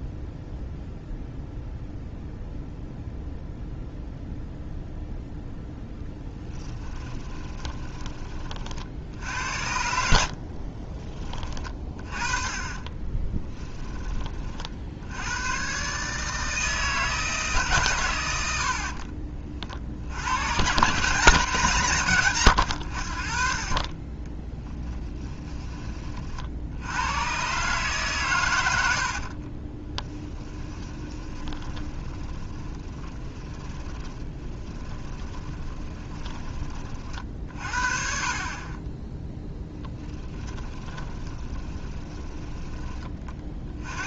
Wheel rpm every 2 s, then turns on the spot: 0, 0, 0, 10, 60, 30, 30, 70, 160, 60, 140, 90, 10, 90, 80, 20, 20, 20, 30, 20, 20, 20.
6-8 10-14 18-20 28-36 40-42